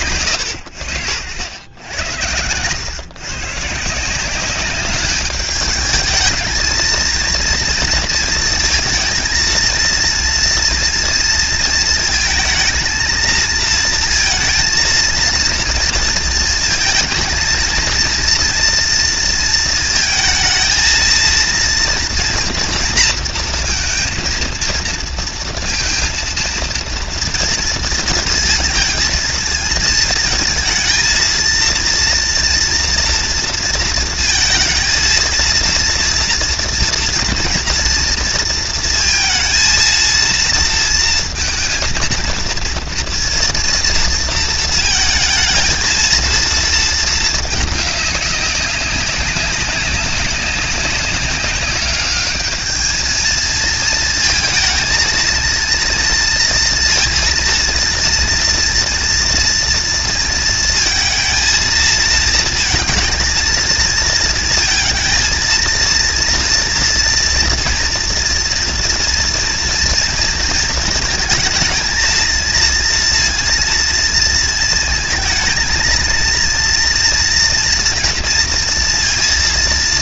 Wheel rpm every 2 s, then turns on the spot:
90, 120, 200, 230, 230, 230, 220, 230, 230, 230, 220, 230, 230, 230, 230, 230, 230, 230, 240, 230, 230, 230, 230, 230, 200, 190, 210, 230, 230, 230, 230, 230, 230, 230, 230, 230, 230, 220, 230, 230.
none